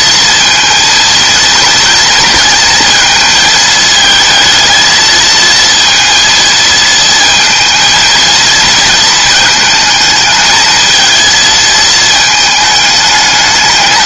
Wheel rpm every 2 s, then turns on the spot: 230, 220, 220, 230, 230, 220, 210.
none